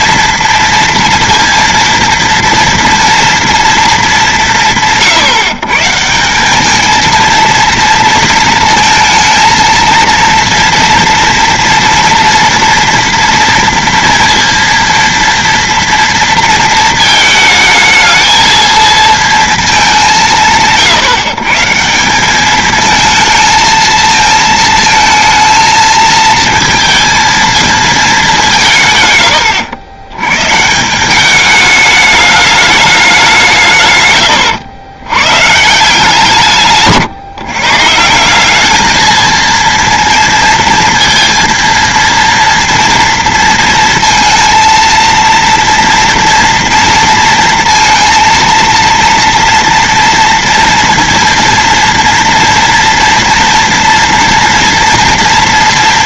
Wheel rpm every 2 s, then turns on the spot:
240, 230, 200, 160, 230, 230, 230, 230, 230, 220, 180, 190, 220, 220, 210, 110, 210, 130, 160, 170, 230, 230, 230, 230, 230, 230, 230, 230.
none